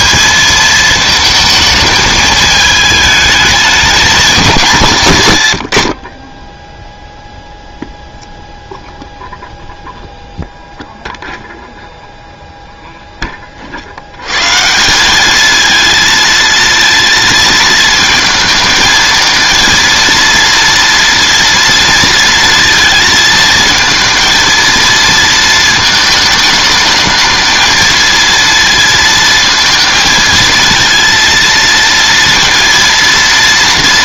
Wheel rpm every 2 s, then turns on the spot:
220, 210, 160, 0, 0, 0, 10, 180, 220, 220, 230, 220, 230, 220, 230, 230, 230.
none